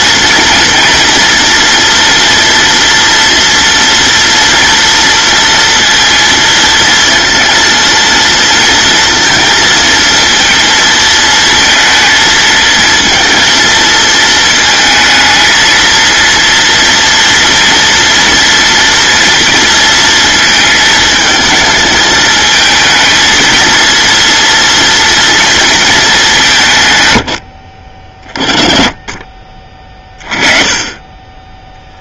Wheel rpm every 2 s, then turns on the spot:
240, 230, 230, 230, 230, 220, 230, 220, 230, 230, 220, 220, 230, 120, 20, 20.
none